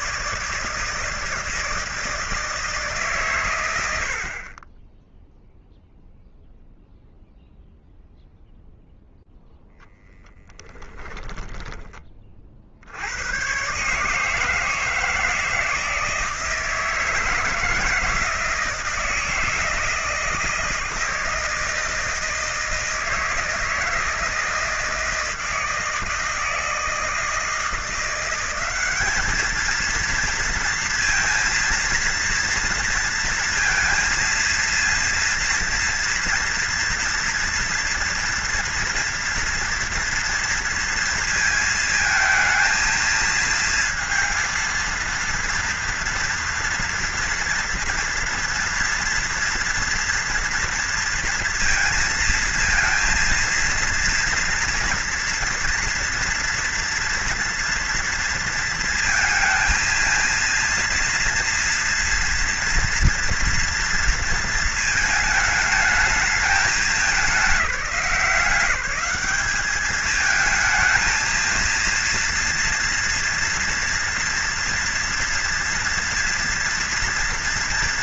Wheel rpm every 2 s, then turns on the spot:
160, 140, 0, 0, 0, 20, 140, 160, 160, 160, 160, 160, 160, 170, 230, 230, 230, 240, 230, 230, 220, 230, 240, 230, 230, 230, 230, 230, 230, 230, 230, 230, 220, 190, 200, 230, 230, 230, 230.
none